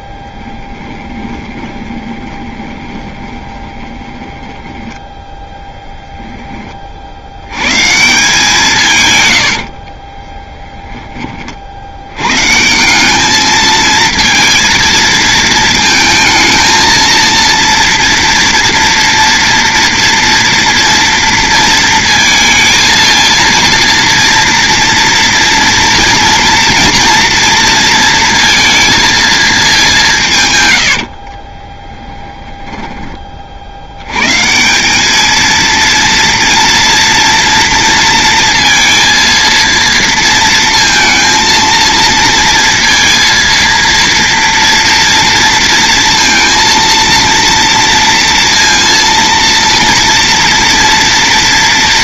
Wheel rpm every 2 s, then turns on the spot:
10, 20, 10, 30, 150, 10, 170, 220, 220, 230, 230, 230, 230, 230, 230, 100, 20, 180, 240, 230, 230, 230, 230, 230, 230, 230.
0-6 30-34